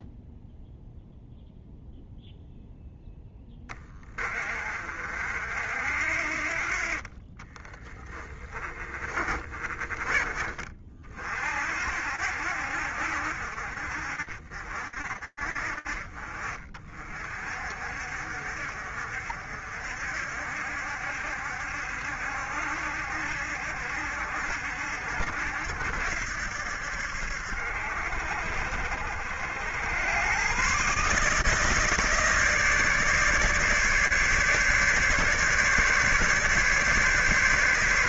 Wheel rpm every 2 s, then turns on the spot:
0, 0, 40, 50, 20, 40, 70, 50, 40, 50, 70, 70, 70, 70, 70, 140, 140, 140, 140.
8-10